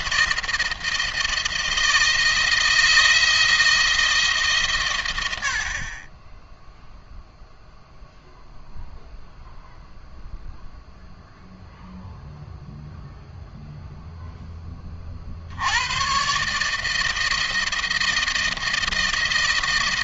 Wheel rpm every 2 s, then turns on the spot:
160, 160, 140, 10, 0, 0, 0, 20, 150, 160.
none